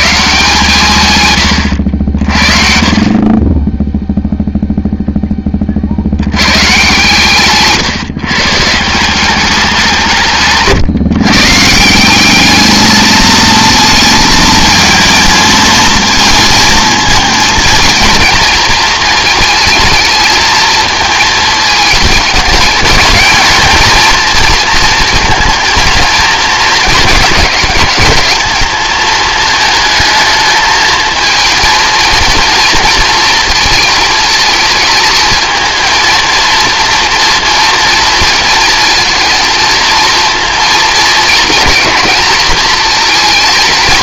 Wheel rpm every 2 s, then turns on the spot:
160, 30, 0, 130, 170, 140, 220, 220, 220, 230, 220, 220, 230, 210, 220, 220, 230, 220, 230, 230, 230, 230.
none